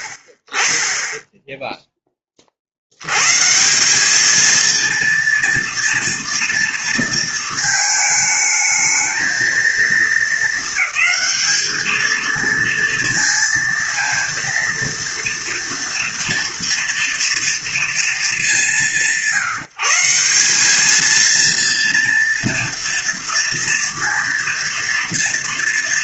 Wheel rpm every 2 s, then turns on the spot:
50, 50, 230, 230, 220, 220, 230, 230, 230, 180, 200, 230, 240.
none